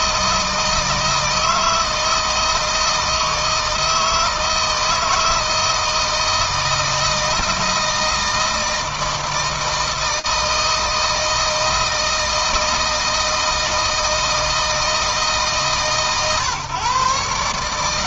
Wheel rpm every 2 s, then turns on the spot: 160, 160, 160, 160, 160, 170, 160, 160, 140.
none